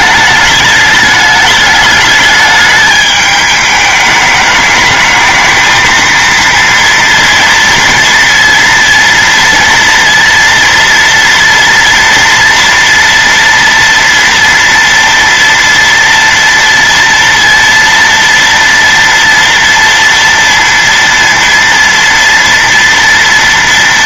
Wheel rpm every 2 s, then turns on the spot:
210, 210, 210, 230, 230, 230, 230, 230, 230, 230, 230, 230.
none